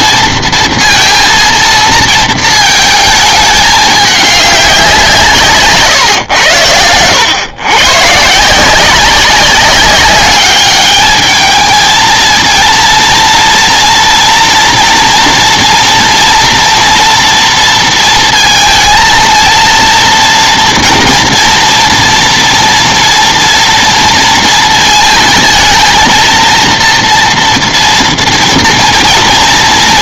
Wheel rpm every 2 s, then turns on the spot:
230, 220, 200, 100, 160, 200, 230, 240, 230, 230, 230, 230, 220, 230, 230.
none